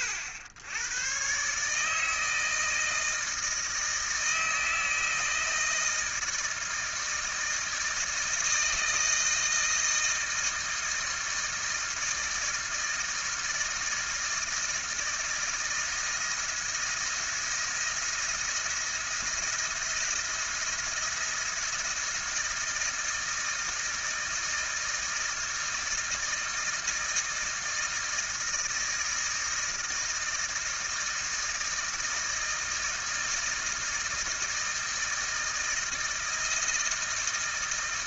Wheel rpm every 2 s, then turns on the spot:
100, 160, 160, 160, 160, 160, 160, 160, 170, 170, 170, 160, 160, 160, 160, 160, 160, 160, 160.
none